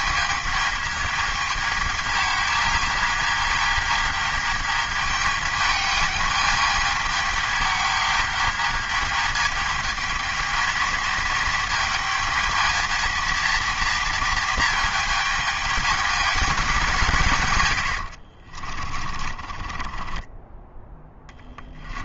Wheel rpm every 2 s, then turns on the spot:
210, 220, 220, 210, 220, 220, 220, 220, 200, 50, 20.
18-22